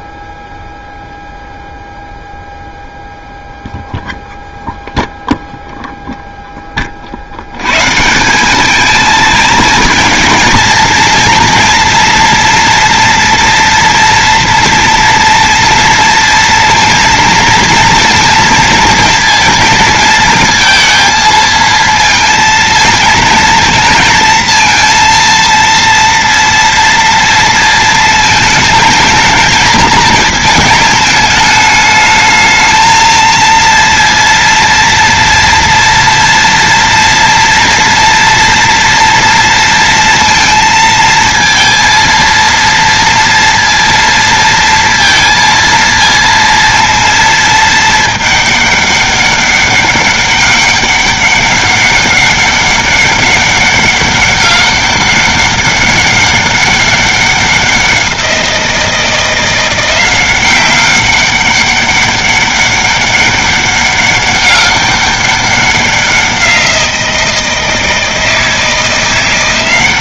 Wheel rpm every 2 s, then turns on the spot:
0, 0, 0, 30, 220, 230, 230, 230, 230, 230, 230, 230, 230, 230, 220, 220, 220, 230, 230, 230, 230, 230, 230, 230, 200, 200, 200, 200, 200, 170, 190, 200, 200, 170, 170.
none